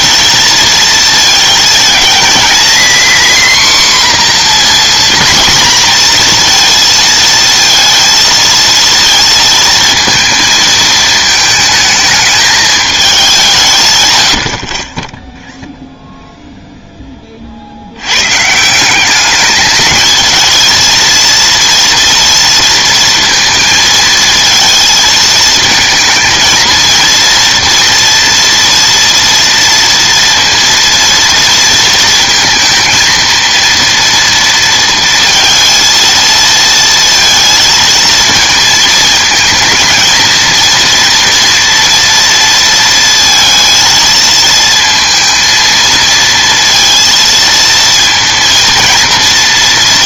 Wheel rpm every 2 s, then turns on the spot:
230, 230, 250, 230, 230, 220, 220, 60, 0, 150, 220, 230, 220, 230, 240, 230, 230, 230, 230, 230, 230, 230, 230, 230, 230.
none